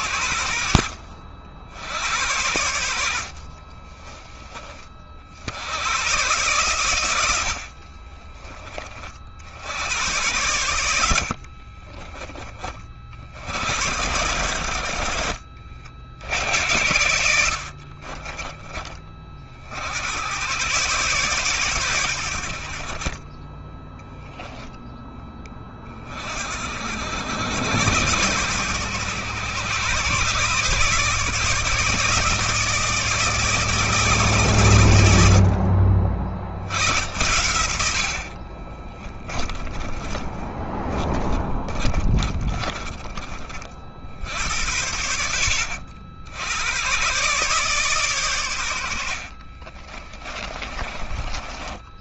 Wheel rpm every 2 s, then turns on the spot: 70, 70, 50, 110, 40, 70, 60, 70, 80, 20, 130, 40, 10, 70, 110, 150, 160, 90, 90, 20, 10, 30, 60, 120, 80, 30.
2-4 10-12 14-16 22-24 38-42 48-50